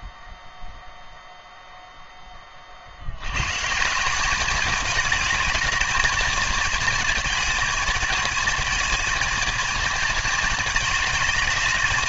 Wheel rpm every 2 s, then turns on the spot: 0, 50, 210, 220, 220, 220.
none